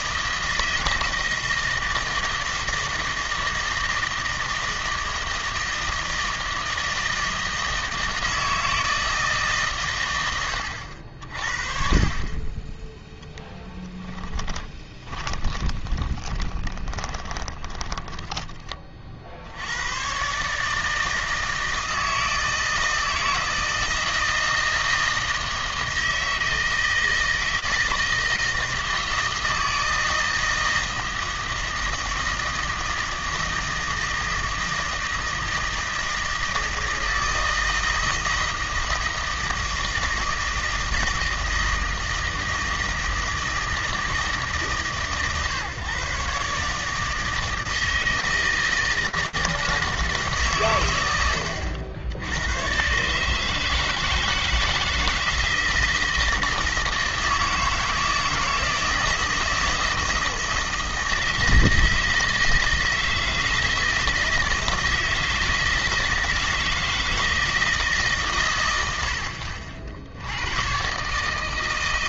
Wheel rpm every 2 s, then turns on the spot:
160, 160, 160, 160, 160, 80, 10, 20, 20, 20, 150, 160, 160, 160, 160, 160, 160, 160, 160, 160, 160, 160, 150, 150, 160, 110, 120, 160, 160, 160, 160, 160, 160, 160, 90, 130.
14-18